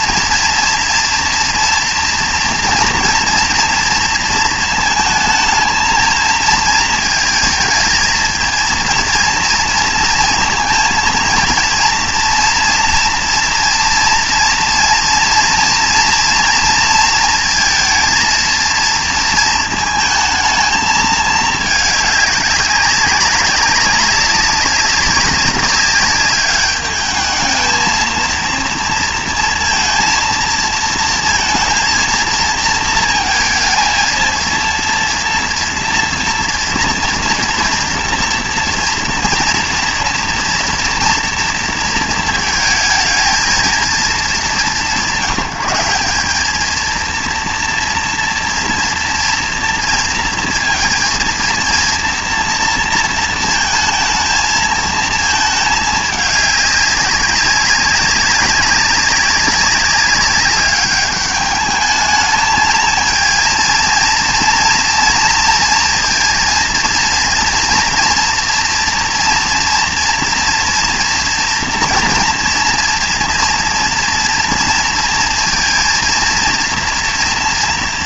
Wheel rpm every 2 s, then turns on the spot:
240, 240, 220, 220, 230, 230, 230, 240, 240, 230, 220, 200, 200, 210, 230, 230, 230, 230, 230, 230, 230, 220, 170, 220, 240, 230, 230, 220, 200, 200, 200, 220, 230, 230, 230, 240, 230, 230, 230.
none